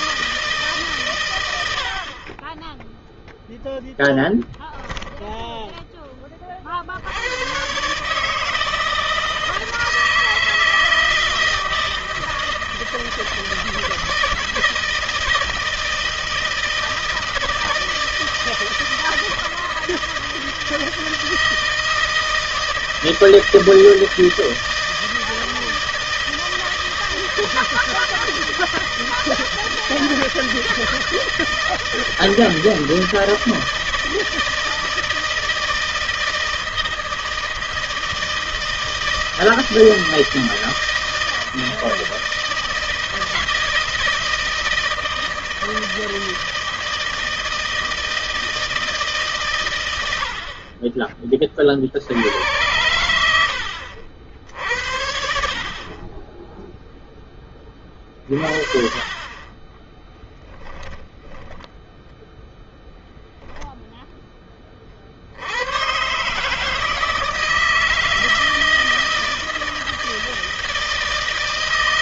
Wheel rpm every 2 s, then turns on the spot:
130, 0, 10, 70, 160, 160, 160, 160, 160, 160, 160, 160, 160, 160, 160, 160, 160, 160, 160, 160, 160, 160, 160, 160, 150, 30, 100, 60, 0, 30, 20, 0, 40, 150, 160, 160.
4-6 60-62